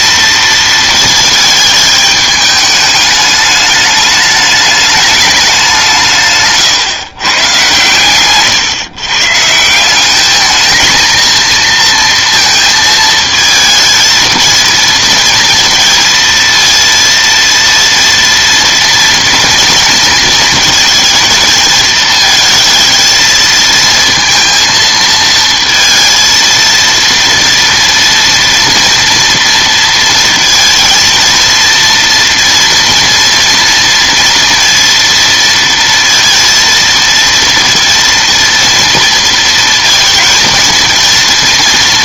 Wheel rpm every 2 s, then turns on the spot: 230, 210, 210, 140, 130, 220, 230, 220, 230, 230, 230, 220, 230, 230, 230, 230, 230, 230, 230, 230, 230.
none